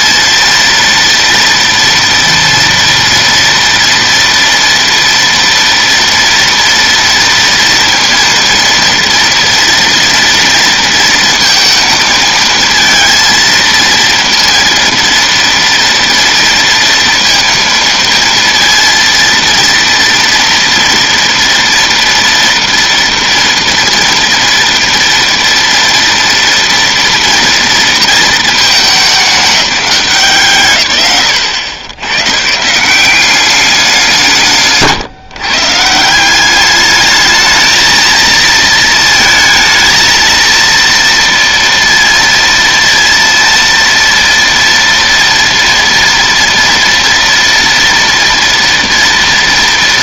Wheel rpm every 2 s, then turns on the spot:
230, 230, 230, 230, 230, 230, 230, 230, 230, 230, 230, 230, 230, 240, 210, 150, 180, 140, 210, 230, 230, 230, 230, 230, 230.
34-36